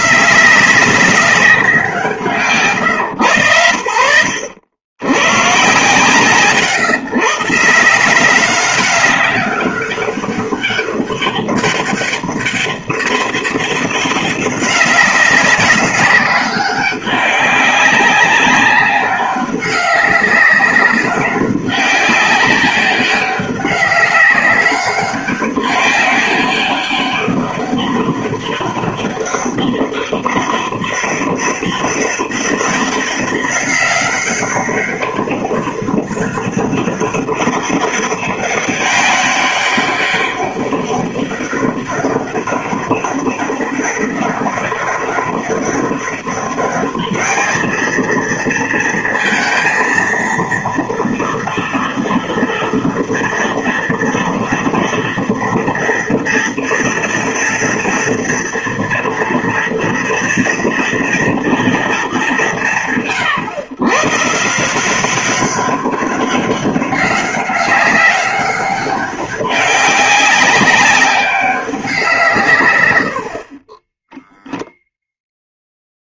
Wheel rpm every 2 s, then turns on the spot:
170, 150, 90, 120, 190, 200, 200, 190, 190, 200, 190, 190, 200, 200, 200, 190, 200, 200, 200, 200, 200, 200, 200, 200, 230, 230, 230, 230, 240, 230, 240, 160, 160, 200, 200, 190, 130, 0.
none